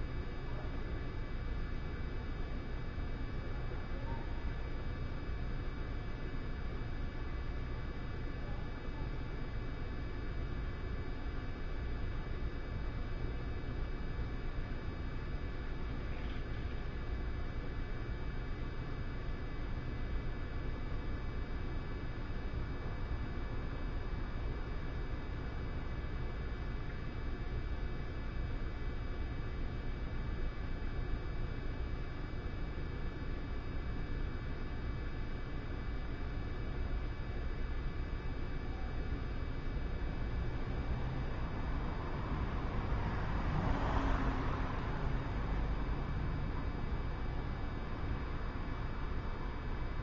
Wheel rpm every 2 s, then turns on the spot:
0, 0, 0, 0, 0, 0, 0, 0, 0, 0, 0, 0, 0, 0, 0, 0, 0, 0, 0, 0, 0, 0, 0, 0, 0.
none